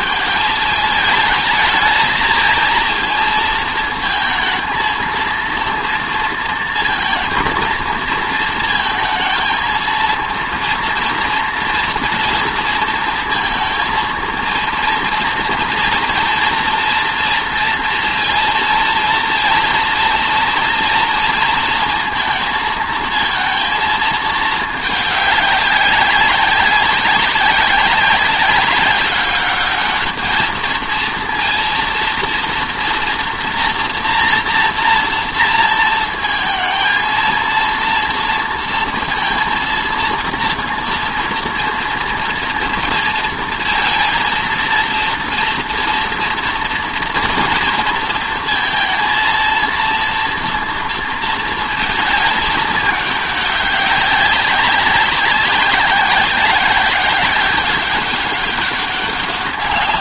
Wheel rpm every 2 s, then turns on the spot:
210, 220, 230, 230, 230, 230, 230, 230, 240, 230, 230, 220, 210, 190, 190, 220, 230, 230, 230, 230, 230, 230, 230, 240, 230, 230, 210, 190, 190, 200.
none